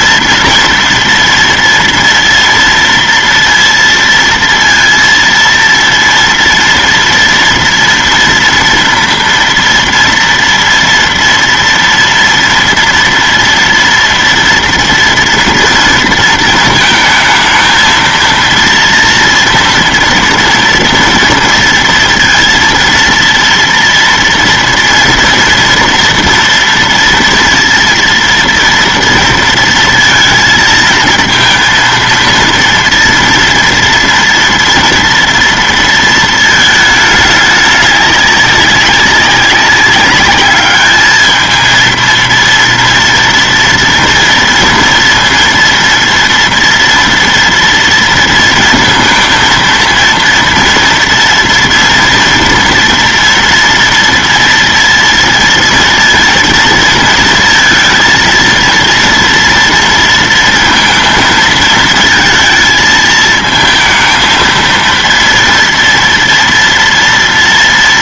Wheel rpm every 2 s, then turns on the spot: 230, 230, 230, 230, 230, 230, 230, 230, 220, 230, 230, 230, 230, 230, 230, 220, 230, 230, 220, 200, 210, 230, 230, 240, 230, 240, 240, 230, 230, 230, 230, 220, 230, 230.
none